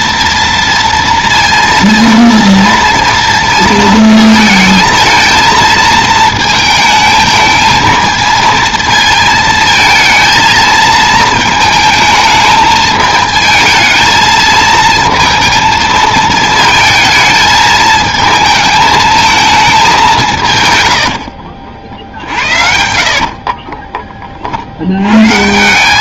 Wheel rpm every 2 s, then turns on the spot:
230, 230, 220, 220, 230, 220, 220, 230, 220, 220, 90, 80, 90.
20-22